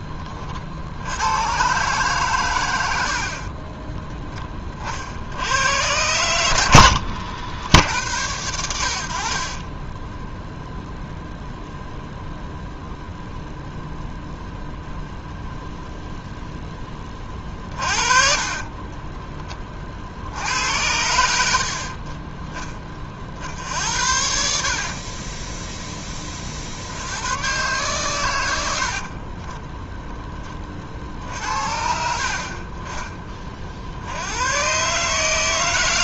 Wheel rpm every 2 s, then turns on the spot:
50, 90, 40, 90, 80, 0, 0, 0, 10, 30, 80, 10, 60, 60, 80, 30, 30, 130.
6-8 18-20 24-26